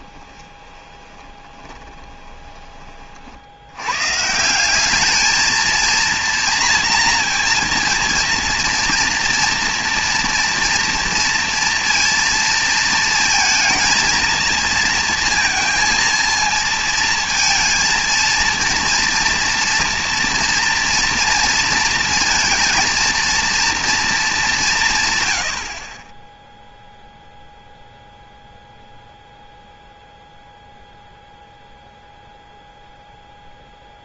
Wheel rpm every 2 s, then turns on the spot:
20, 20, 170, 230, 230, 230, 230, 230, 230, 230, 230, 230, 190, 0, 0, 0, 0.
0-2